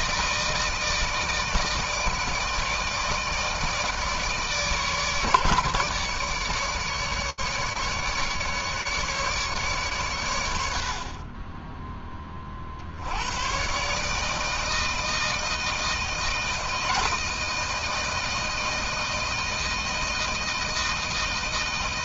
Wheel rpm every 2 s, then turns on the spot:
160, 160, 150, 150, 150, 70, 30, 160, 160, 160, 160.
none